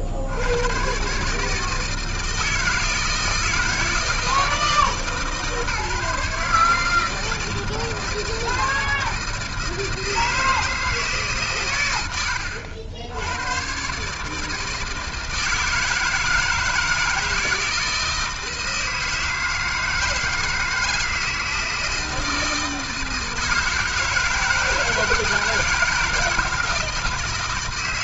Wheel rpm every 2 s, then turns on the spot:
100, 160, 160, 150, 160, 160, 70, 160, 160, 160, 160, 160, 160, 160.
none